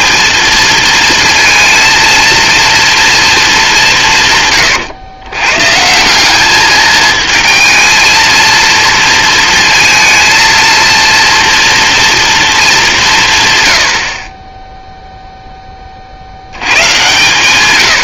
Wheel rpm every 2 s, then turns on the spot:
220, 230, 110, 210, 230, 230, 200, 0, 100.
none